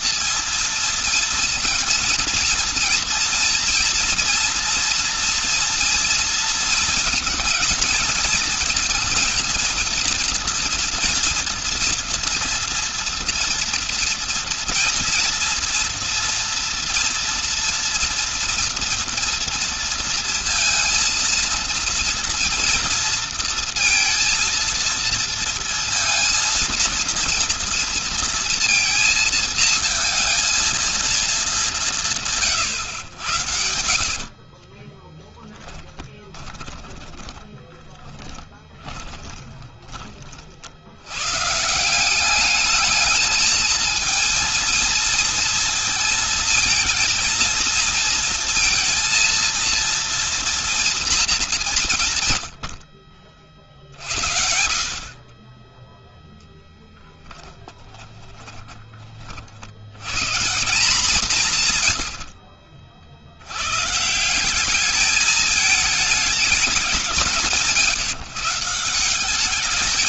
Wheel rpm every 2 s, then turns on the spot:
230, 230, 230, 230, 230, 230, 230, 230, 230, 230, 230, 230, 230, 230, 230, 230, 130, 30, 10, 40, 90, 200, 230, 230, 230, 230, 70, 50, 10, 30, 180, 50, 200, 190, 170.
34-40